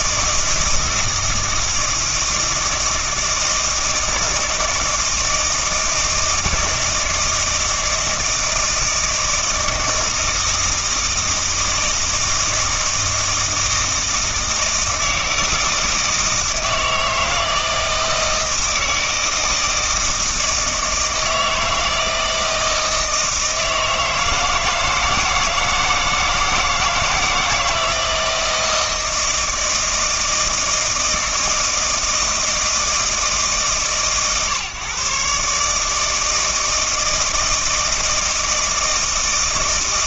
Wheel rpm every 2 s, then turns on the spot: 160, 160, 160, 160, 160, 160, 160, 160, 160, 160, 160, 160, 160, 160, 160, 160, 160, 130, 160, 160.
none